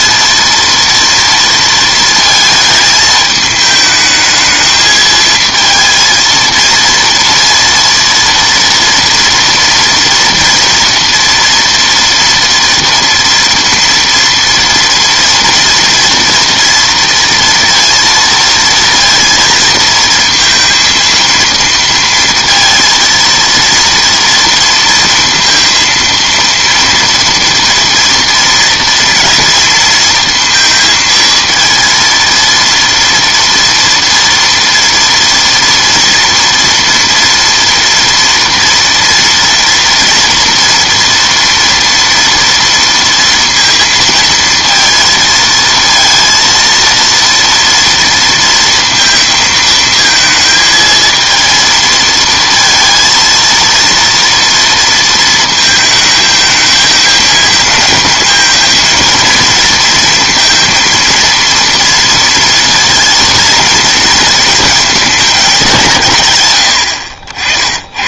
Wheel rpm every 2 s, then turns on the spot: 230, 220, 220, 230, 230, 230, 230, 230, 230, 230, 230, 230, 230, 230, 230, 230, 230, 230, 240, 230, 230, 230, 230, 230, 230, 220, 230, 230, 220, 220, 230, 230, 220, 100.
none